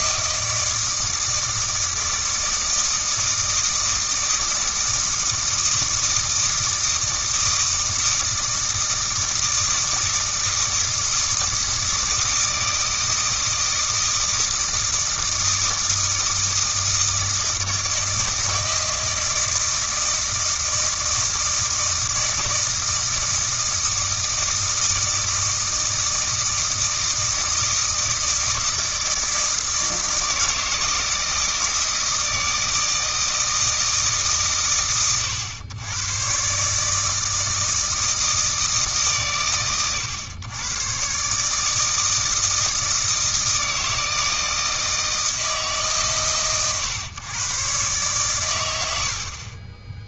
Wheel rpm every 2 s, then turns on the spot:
160, 160, 160, 160, 160, 160, 160, 160, 160, 160, 160, 160, 160, 160, 160, 160, 160, 130, 150, 150, 120, 160, 160, 130, 90.
none